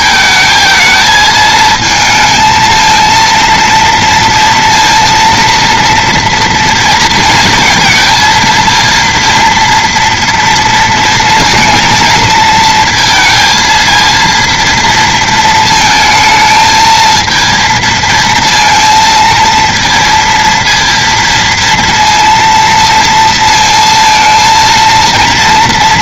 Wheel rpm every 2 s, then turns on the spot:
220, 220, 230, 230, 230, 230, 230, 230, 220, 230, 230, 230, 230.
none